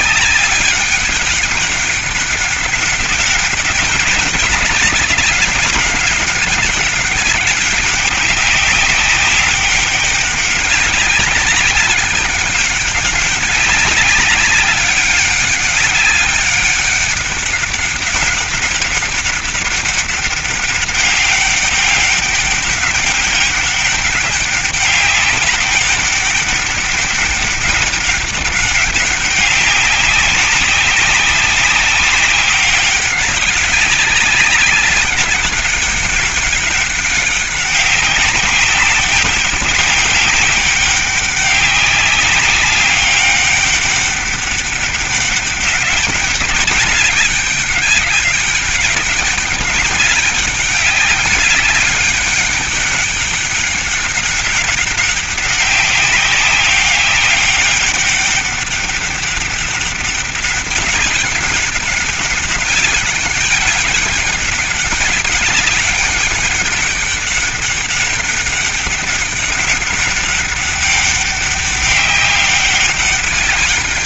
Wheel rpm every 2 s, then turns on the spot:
200, 200, 200, 190, 190, 190, 200, 200, 200, 200, 200, 200, 200, 200, 200, 190, 190, 200, 200, 190, 200, 200, 200, 200, 190, 200, 200, 200, 200, 200, 190, 200, 190, 200, 200, 200, 200.
none